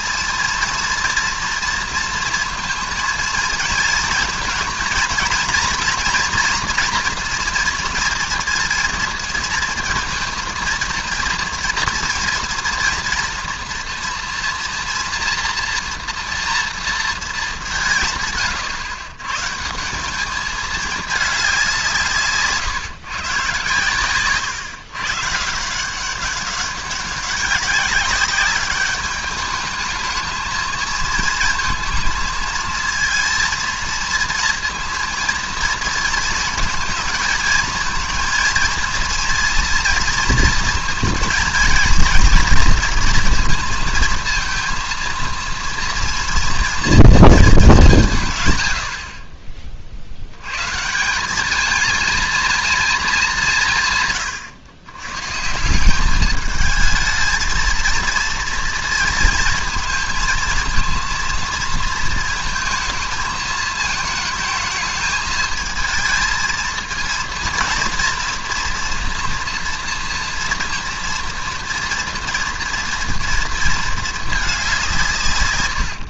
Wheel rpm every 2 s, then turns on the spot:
230, 230, 230, 240, 230, 230, 240, 230, 230, 120, 220, 140, 120, 200, 200, 220, 230, 230, 230, 230, 230, 230, 230, 230, 80, 140, 230, 120, 220, 230, 230, 220, 220, 230, 240, 230, 230, 180.
none